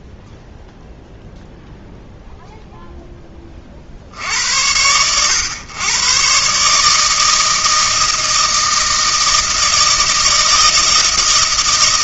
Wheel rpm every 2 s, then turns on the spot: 0, 10, 80, 160, 160, 160.
none